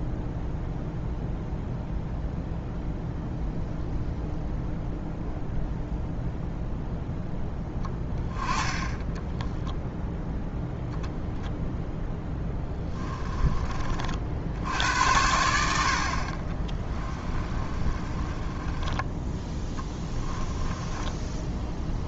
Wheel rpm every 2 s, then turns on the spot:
0, 0, 0, 0, 10, 0, 10, 70, 30, 20, 10.
12-14 16-22